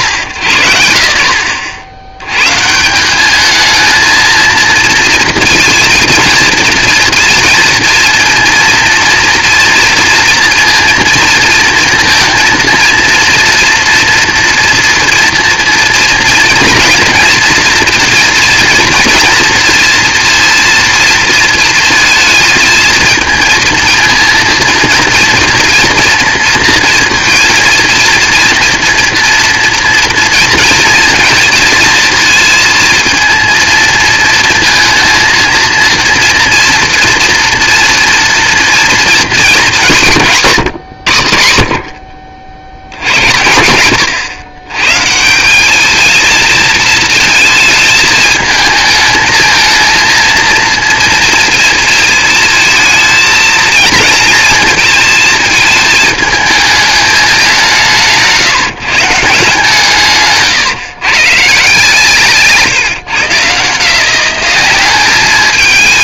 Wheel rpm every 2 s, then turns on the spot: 100, 130, 230, 230, 230, 230, 230, 240, 240, 230, 230, 220, 230, 230, 230, 230, 230, 220, 240, 240, 170, 70, 130, 220, 220, 230, 230, 230, 220, 150, 130, 140, 200.
40-42